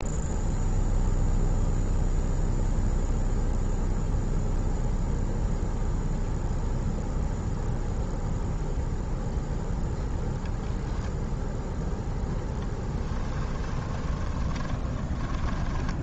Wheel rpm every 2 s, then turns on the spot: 0, 0, 0, 0, 0, 0, 10, 20.
12-16